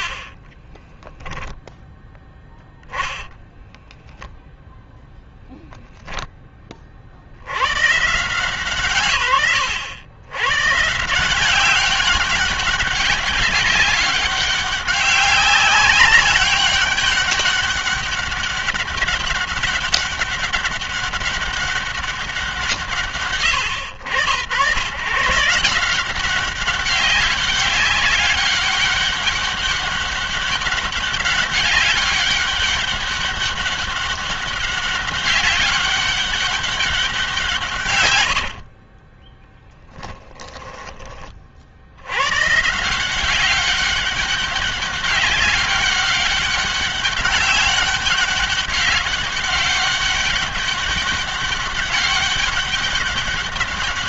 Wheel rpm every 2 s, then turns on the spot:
20, 10, 0, 30, 130, 140, 190, 190, 200, 200, 200, 160, 120, 190, 200, 200, 200, 190, 190, 50, 20, 150, 200, 200, 200, 200, 200.
0-2 38-40